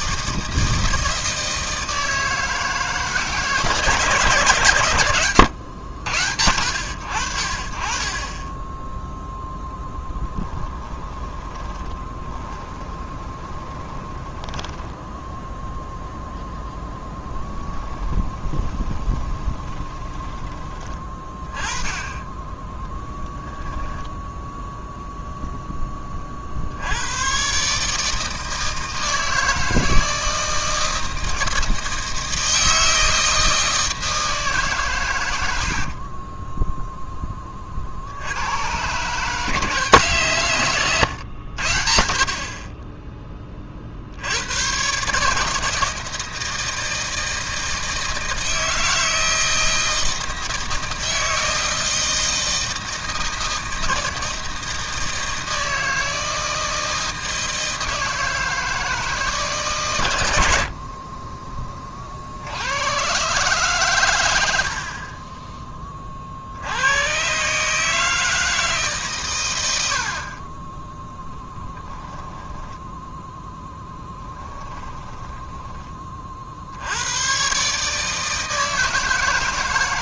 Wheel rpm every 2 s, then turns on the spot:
160, 160, 110, 70, 10, 20, 20, 10, 0, 20, 20, 10, 0, 70, 160, 160, 160, 150, 10, 120, 130, 30, 110, 160, 160, 160, 160, 160, 160, 160, 60, 90, 70, 90, 150, 20, 10, 10, 70, 160.
10-16 18-20 60-62 74-76